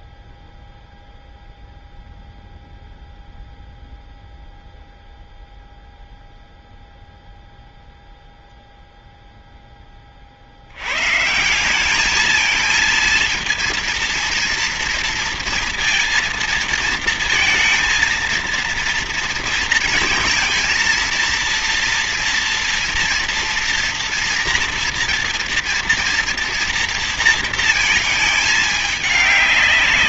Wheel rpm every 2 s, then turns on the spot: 0, 0, 0, 0, 0, 70, 220, 230, 230, 230, 230, 230, 230, 230, 210.
none